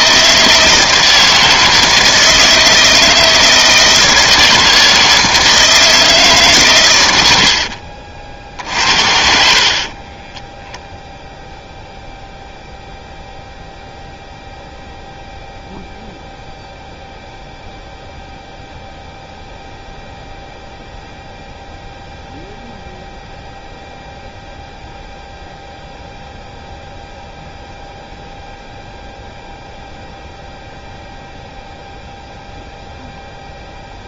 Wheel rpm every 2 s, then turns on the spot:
160, 160, 160, 130, 60, 0, 0, 0, 0, 0, 0, 0, 0, 0, 0, 0, 0.
none